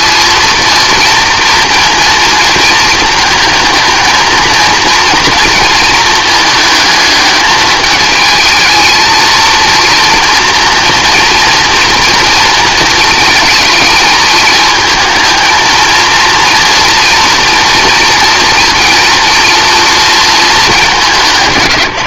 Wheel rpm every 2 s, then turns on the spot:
230, 230, 230, 220, 220, 230, 220, 220, 230, 230, 200.
none